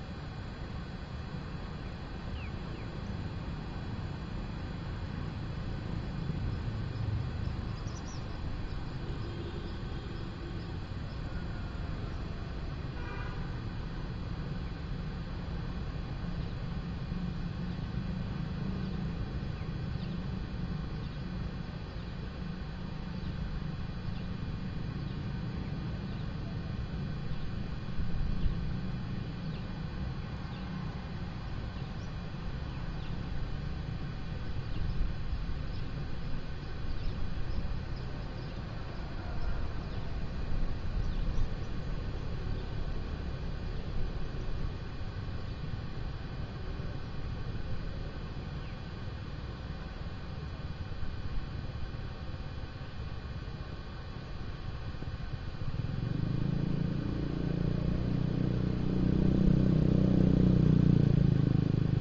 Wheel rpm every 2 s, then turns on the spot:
0, 0, 0, 0, 0, 0, 0, 0, 0, 0, 0, 0, 0, 0, 0, 0, 0, 0, 0, 0, 0, 0, 0, 0, 0, 0, 0, 0, 0, 0, 0.
none